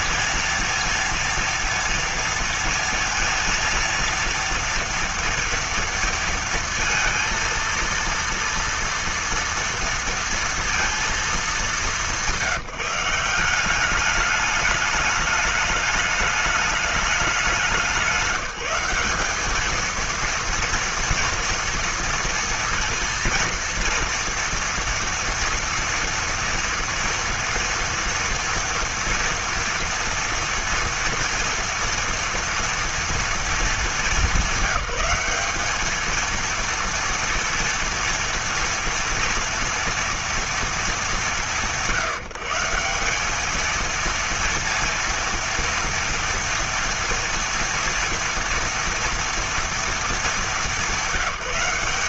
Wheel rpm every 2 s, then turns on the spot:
230, 230, 230, 230, 230, 230, 180, 210, 210, 180, 230, 230, 230, 230, 240, 230, 230, 200, 230, 230, 210, 170, 230, 230, 230, 210.
none